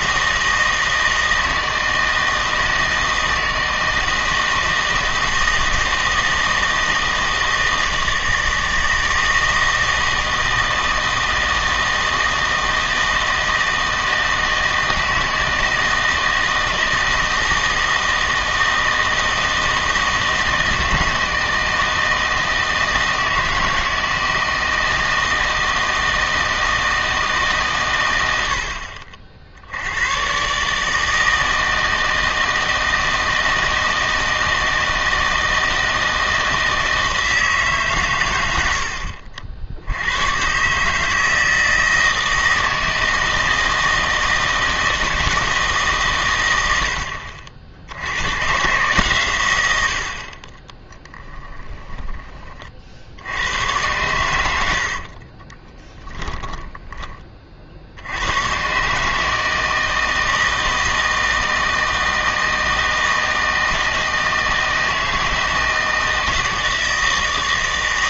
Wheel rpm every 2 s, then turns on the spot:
160, 160, 160, 160, 160, 160, 160, 160, 170, 160, 160, 160, 160, 160, 60, 150, 160, 160, 160, 70, 150, 160, 160, 80, 140, 10, 60, 70, 10, 130, 160, 160, 160, 160.
50-52 54-56